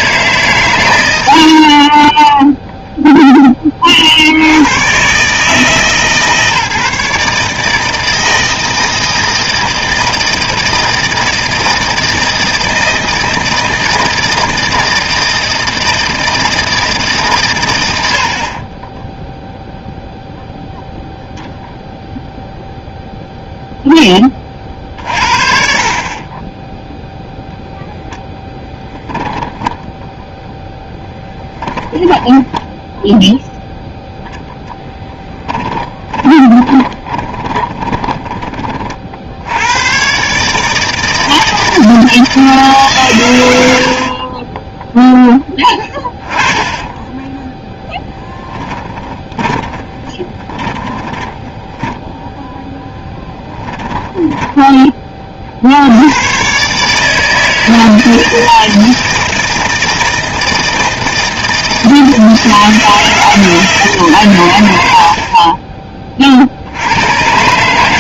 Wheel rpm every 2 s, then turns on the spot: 140, 0, 90, 150, 160, 160, 160, 160, 160, 30, 0, 0, 30, 10, 10, 0, 0, 0, 20, 30, 150, 150, 20, 20, 10, 30, 10, 10, 130, 160, 160, 160, 100, 60.
36-38 46-52